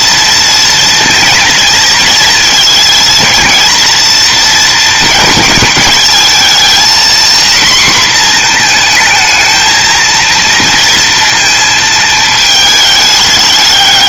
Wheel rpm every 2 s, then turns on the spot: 230, 230, 220, 240, 230, 230, 210.
none